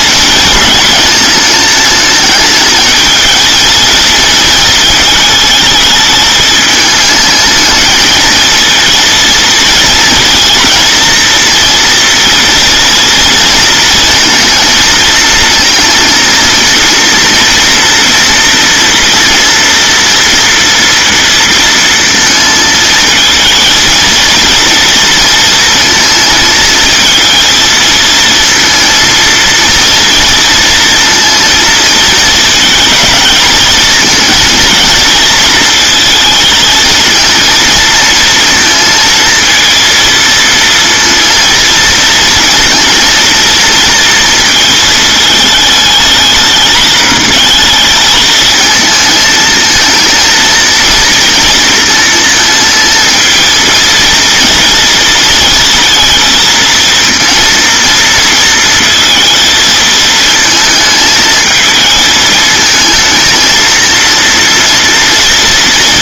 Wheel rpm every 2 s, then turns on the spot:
220, 220, 220, 210, 230, 240, 230, 230, 230, 230, 230, 220, 230, 220, 230, 230, 230, 230, 230, 230, 230, 230, 220, 210, 220, 230, 230, 230, 230, 230, 220, 220, 230.
none